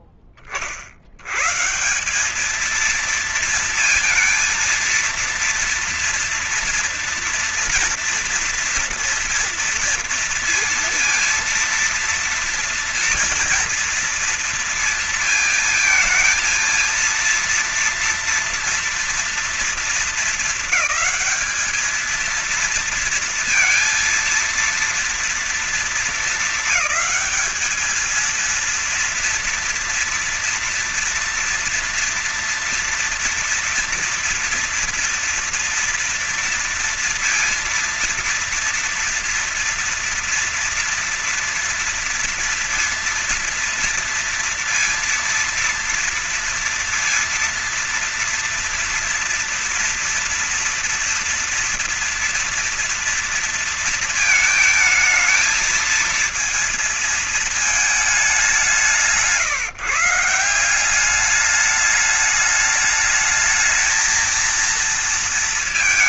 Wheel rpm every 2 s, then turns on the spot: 20, 210, 230, 240, 230, 230, 230, 230, 230, 230, 200, 220, 230, 220, 230, 230, 230, 240, 230, 230, 230, 230, 230, 230, 230, 230, 230, 220, 230, 200, 180, 210, 230.
none